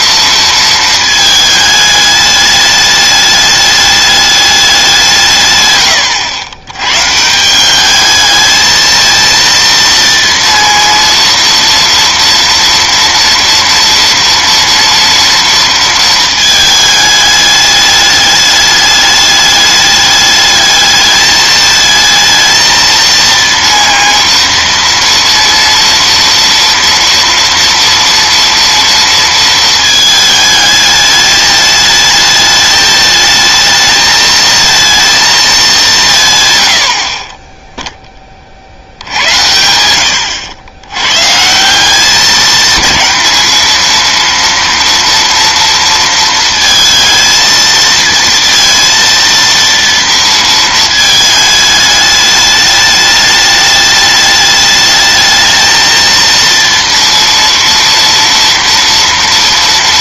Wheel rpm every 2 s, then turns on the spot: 230, 210, 190, 110, 220, 230, 240, 240, 220, 210, 210, 220, 230, 230, 230, 220, 220, 230, 90, 70, 90, 210, 230, 230, 230, 220, 210, 210, 230, 240.
none